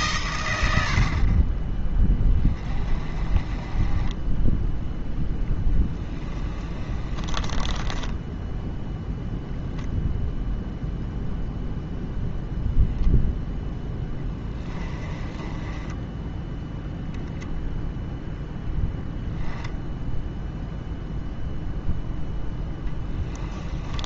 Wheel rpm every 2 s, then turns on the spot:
80, 30, 0, 30, 0, 0, 0, 20, 10, 0, 0, 10.
6-8 14-16 22-24